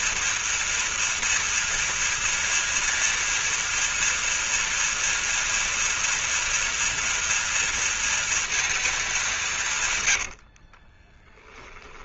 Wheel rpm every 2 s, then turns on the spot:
230, 230, 230, 230, 220, 30.
10-12